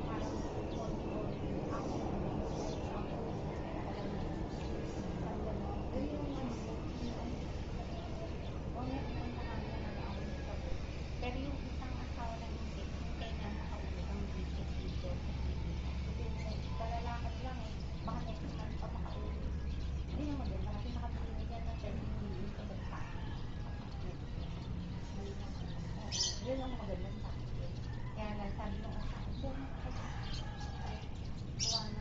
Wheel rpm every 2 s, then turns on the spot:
0, 0, 0, 0, 0, 0, 0, 0, 0, 0, 0, 0, 0, 0, 0, 0.
none